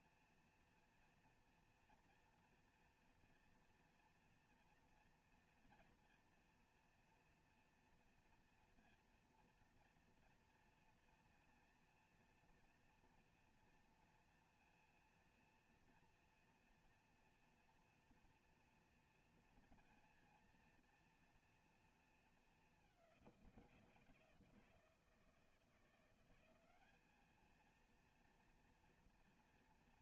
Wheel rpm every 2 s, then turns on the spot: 240, 230, 230, 230, 230, 230, 240, 230, 230, 230, 230, 190, 170, 210, 230.
none